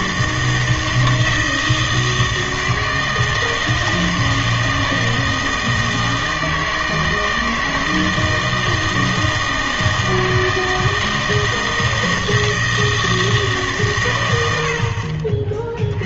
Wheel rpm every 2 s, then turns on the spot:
160, 160, 160, 160, 160, 160, 160, 80.
none